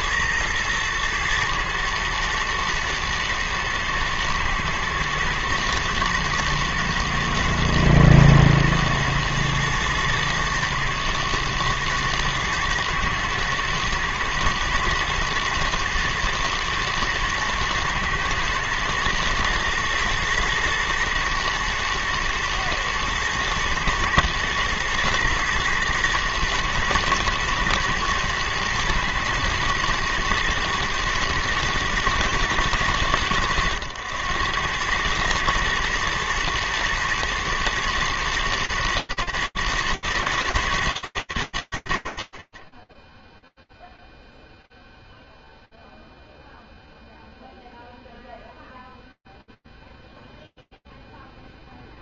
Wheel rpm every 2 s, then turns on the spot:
110, 110, 110, 110, 110, 120, 110, 120, 120, 110, 110, 110, 120, 110, 120, 110, 100, 110, 110, 110, 110, 50, 0, 0, 0, 0.
none